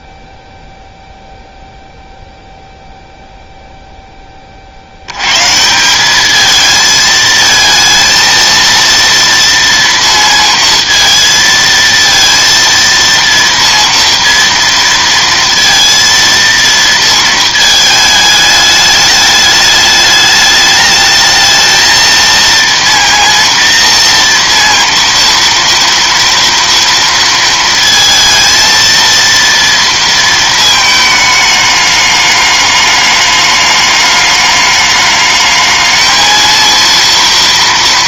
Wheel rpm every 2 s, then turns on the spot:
0, 0, 40, 220, 230, 230, 230, 230, 230, 210, 210, 230, 230, 230, 230, 220, 210, 210, 230.
none